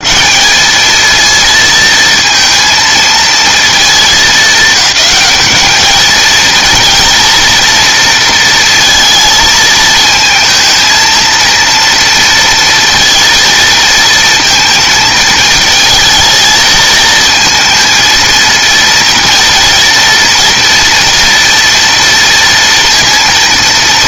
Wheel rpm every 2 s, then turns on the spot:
180, 230, 210, 220, 230, 220, 230, 230, 220, 230, 230, 230.
none